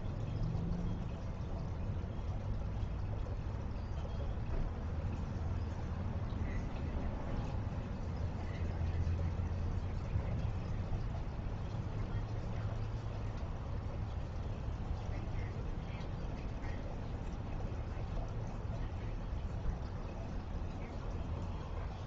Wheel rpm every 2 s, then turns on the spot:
0, 0, 0, 0, 0, 0, 0, 0, 0, 0, 0.
none